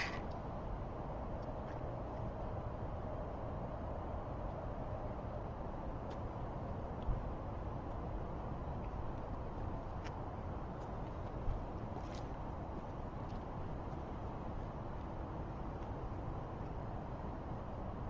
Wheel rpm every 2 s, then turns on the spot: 0, 0, 0, 0, 0, 0, 0, 0, 0.
none